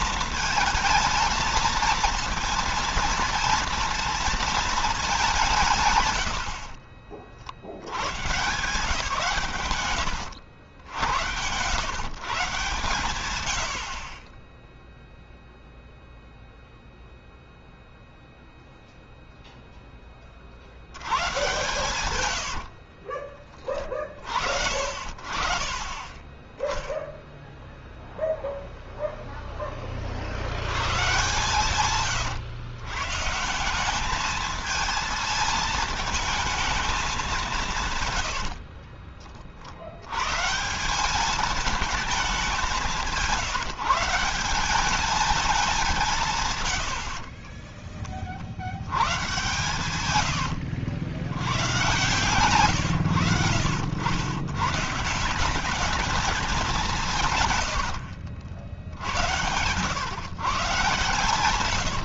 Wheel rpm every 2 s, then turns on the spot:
220, 230, 210, 50, 150, 90, 120, 0, 0, 0, 90, 50, 50, 0, 0, 110, 120, 220, 210, 30, 190, 170, 200, 90, 80, 70, 120, 150, 160, 80, 120.
6-8 22-24 38-40